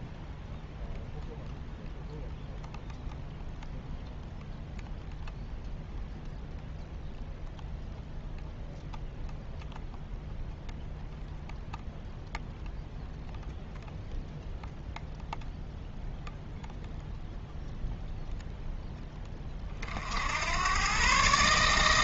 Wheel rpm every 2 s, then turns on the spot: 0, 0, 0, 0, 0, 0, 0, 0, 0, 0, 100.
none